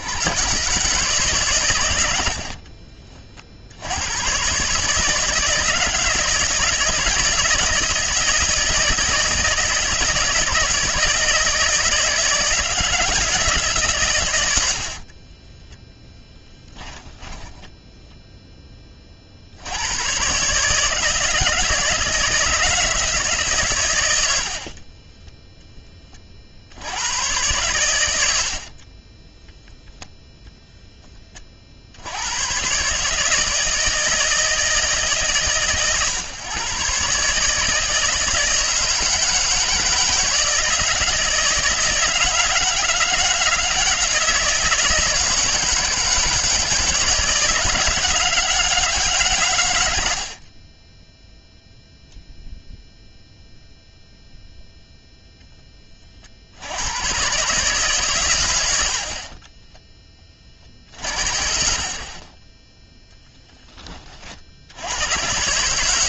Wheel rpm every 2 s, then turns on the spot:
140, 40, 150, 160, 160, 170, 170, 50, 10, 30, 160, 160, 30, 90, 40, 10, 140, 150, 130, 160, 160, 160, 160, 160, 150, 10, 0, 0, 100, 70, 50, 10, 100.
14-18 24-26 28-30